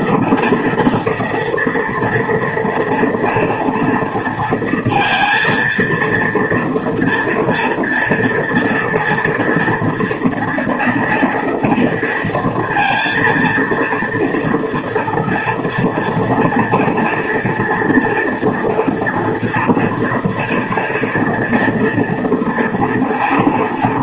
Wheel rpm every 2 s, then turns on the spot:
230, 240, 230, 230, 240, 240, 230, 230, 230, 230, 230, 230.
none